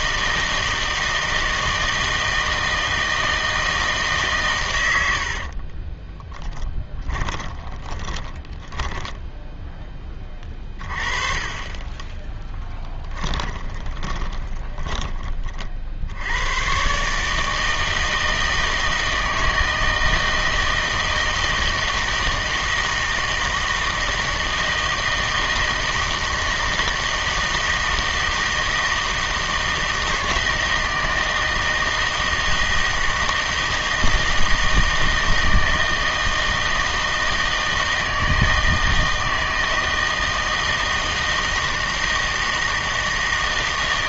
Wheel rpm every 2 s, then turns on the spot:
160, 160, 110, 10, 10, 30, 10, 10, 120, 160, 160, 160, 160, 160, 160, 160, 160, 160, 160, 160, 160, 160.
6-10 12-16